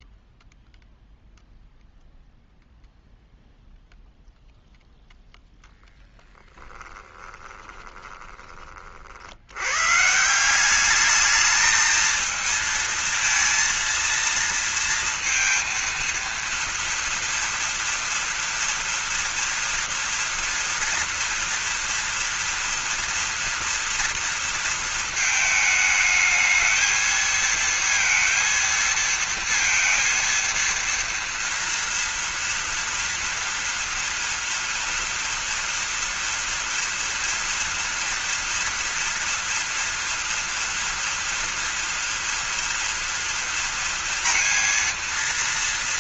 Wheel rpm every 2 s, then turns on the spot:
0, 0, 0, 10, 30, 170, 230, 230, 230, 230, 230, 240, 230, 220, 230, 230, 230, 230, 230, 230, 230, 230, 230.
6-8